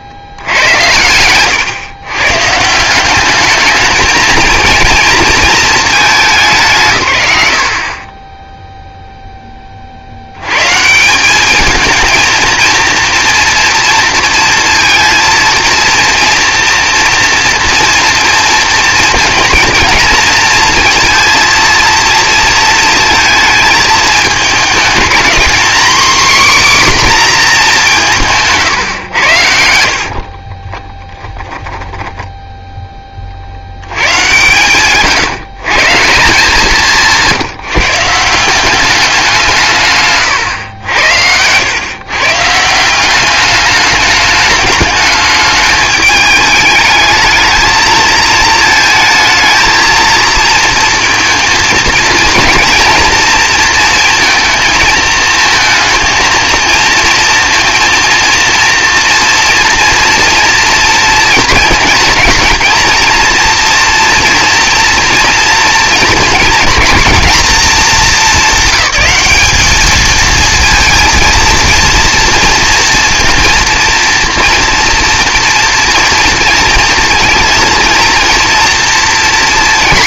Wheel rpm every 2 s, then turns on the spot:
100, 160, 230, 130, 10, 130, 230, 230, 230, 230, 230, 230, 220, 270, 140, 30, 10, 130, 180, 190, 110, 170, 210, 210, 220, 230, 240, 230, 230, 230, 230, 230, 240, 230, 210, 230, 230, 240, 230, 230.
28-32